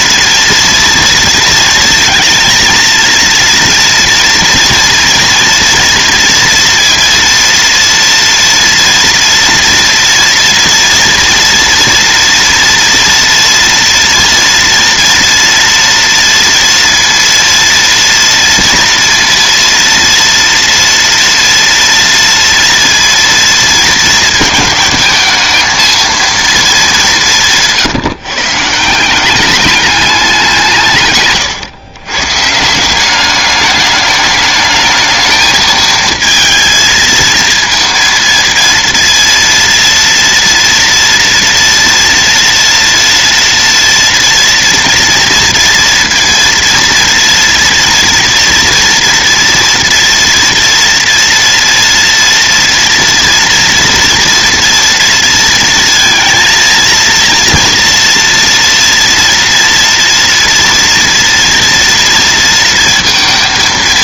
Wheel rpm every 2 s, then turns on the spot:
230, 230, 230, 230, 230, 230, 240, 230, 230, 230, 230, 230, 220, 220, 160, 180, 140, 220, 230, 230, 240, 230, 230, 230, 230, 230, 230, 230, 230, 230, 230, 230.
none